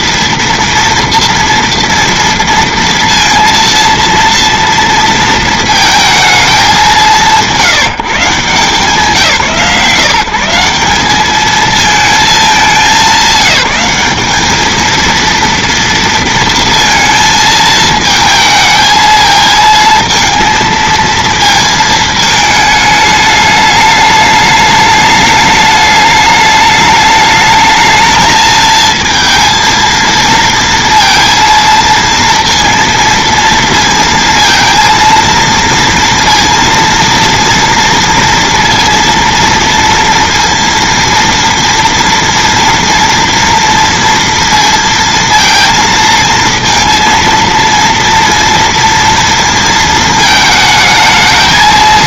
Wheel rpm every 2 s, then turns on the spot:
230, 230, 230, 200, 150, 190, 210, 210, 230, 220, 230, 210, 210, 210, 220, 230, 230, 230, 230, 230, 230, 230, 230, 230, 230, 220.
none